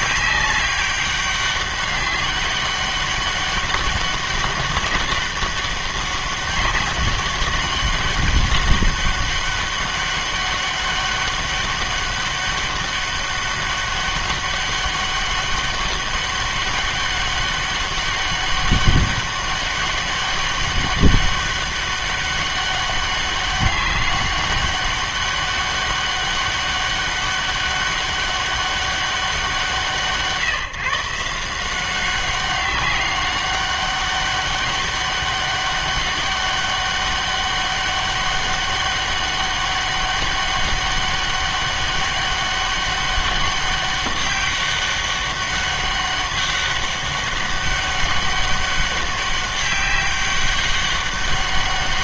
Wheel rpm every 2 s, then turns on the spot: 200, 200, 200, 190, 200, 200, 200, 200, 200, 200, 200, 200, 200, 200, 200, 160, 200, 200, 200, 200, 200, 200, 200, 200, 200, 200.
none